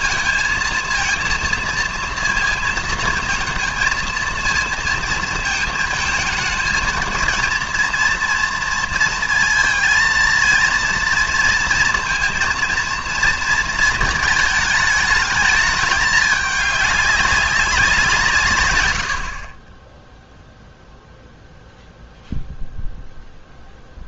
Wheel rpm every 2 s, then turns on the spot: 230, 230, 230, 230, 230, 230, 230, 220, 200, 130, 0, 0.
none